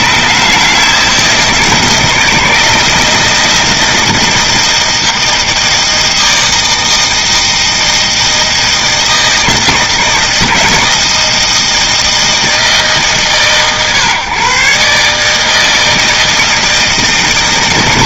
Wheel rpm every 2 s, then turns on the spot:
150, 160, 160, 160, 160, 160, 160, 130, 160.
none